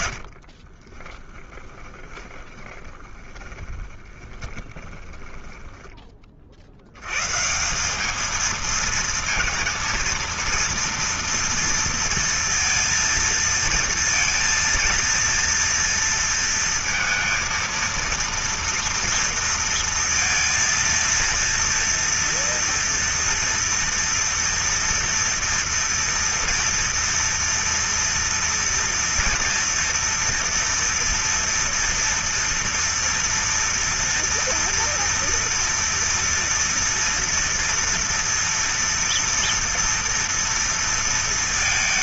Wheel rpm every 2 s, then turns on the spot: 40, 20, 20, 70, 220, 230, 230, 230, 230, 230, 230, 230, 240, 230, 230, 230, 230, 230, 230, 240, 230.
0-6